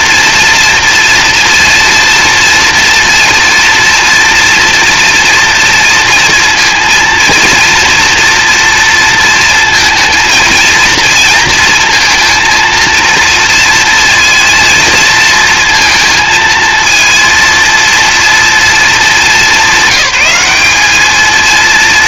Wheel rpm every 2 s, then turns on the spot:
230, 230, 230, 230, 230, 230, 230, 230, 230, 210, 220.
none